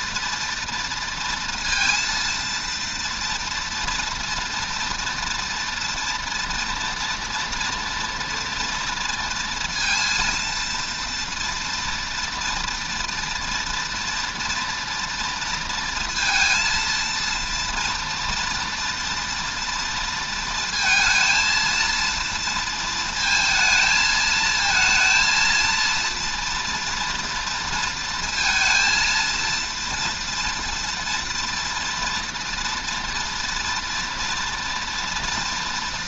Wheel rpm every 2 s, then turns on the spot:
230, 230, 230, 230, 230, 230, 230, 240, 230, 230, 230, 230, 220, 240, 230, 230, 230, 230.
none